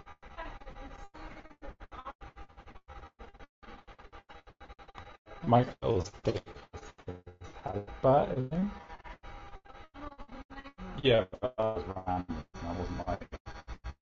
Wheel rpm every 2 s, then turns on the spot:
0, 0, 0, 0, 0, 0, 0.
none